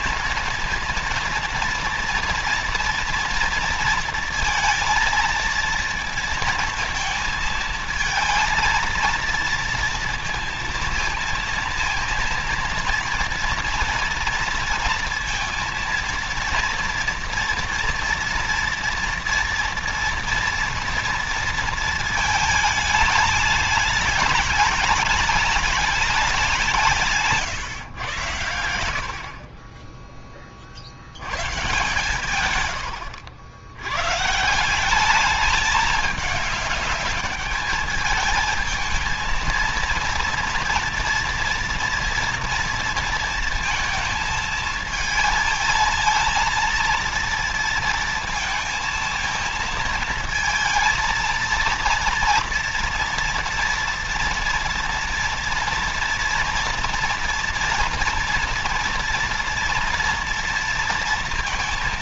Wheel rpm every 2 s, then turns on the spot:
230, 230, 230, 220, 230, 230, 230, 230, 230, 230, 230, 220, 210, 170, 80, 70, 110, 190, 210, 220, 230, 230, 220, 230, 230, 230, 230, 240, 240, 230, 230.
none